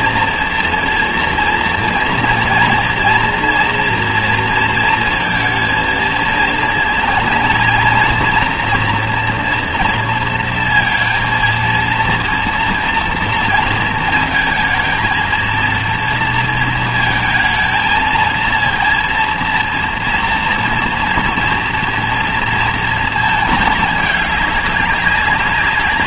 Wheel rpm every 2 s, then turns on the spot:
230, 240, 230, 220, 240, 230, 230, 230, 230, 230, 240, 230, 200.
none